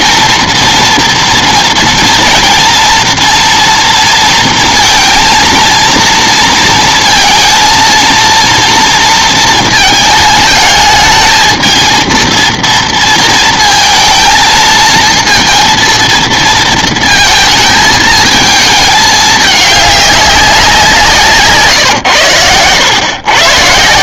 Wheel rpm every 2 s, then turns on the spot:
230, 230, 230, 230, 230, 220, 230, 230, 230, 220, 190, 100.
none